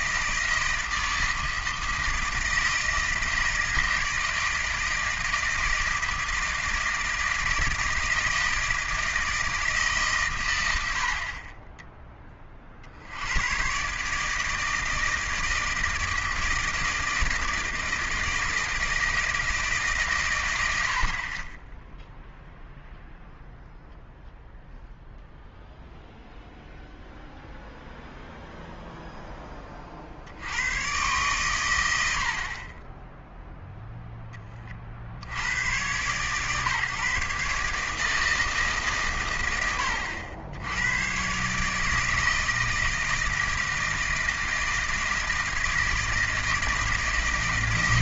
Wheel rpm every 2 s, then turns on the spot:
160, 160, 160, 160, 160, 110, 40, 160, 160, 160, 100, 0, 0, 0, 0, 90, 40, 30, 150, 160, 90, 160, 160, 160.
none